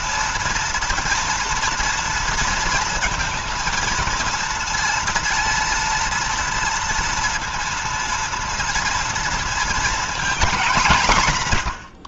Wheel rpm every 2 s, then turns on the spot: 230, 230, 230, 230, 230, 200.
none